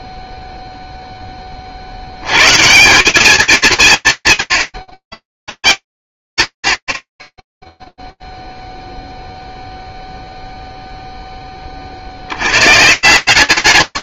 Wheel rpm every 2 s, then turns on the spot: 0, 140, 80, 90, 0, 0, 100.
none